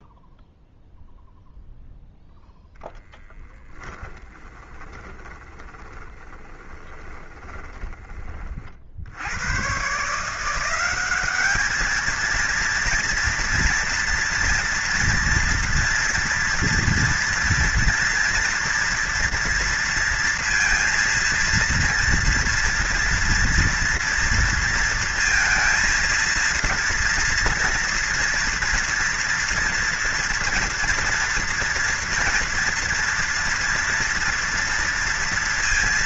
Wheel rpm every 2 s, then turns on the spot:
0, 0, 10, 20, 30, 170, 220, 230, 230, 230, 230, 230, 230, 230, 230, 230, 230, 230.
4-8